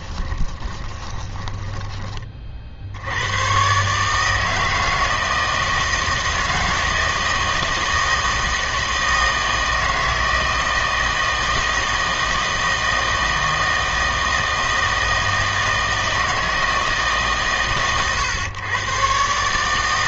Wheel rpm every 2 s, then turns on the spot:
20, 50, 160, 160, 160, 160, 160, 160, 160, 120.
0-2